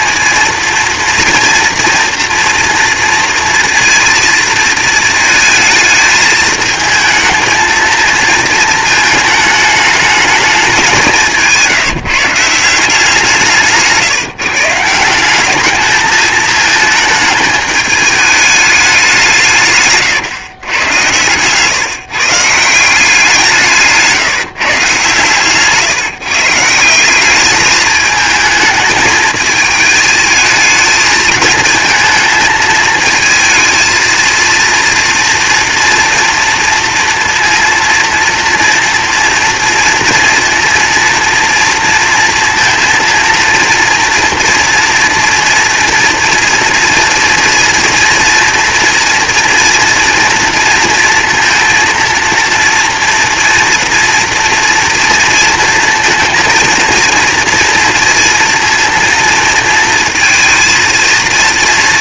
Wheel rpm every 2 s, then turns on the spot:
230, 230, 220, 220, 220, 180, 160, 180, 220, 180, 130, 170, 130, 190, 220, 220, 220, 230, 230, 230, 230, 230, 230, 230, 230, 230, 230, 230, 230, 230, 230.
none